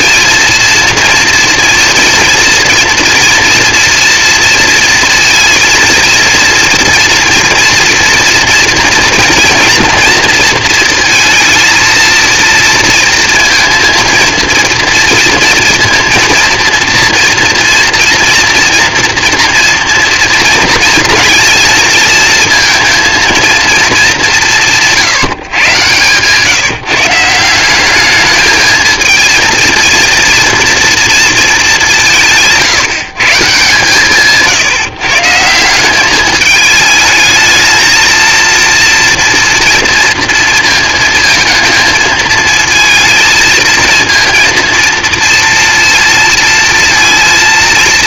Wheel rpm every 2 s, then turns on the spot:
230, 230, 230, 230, 230, 230, 230, 230, 230, 230, 230, 230, 160, 150, 220, 230, 150, 150, 220, 230, 230, 220, 230, 230.
none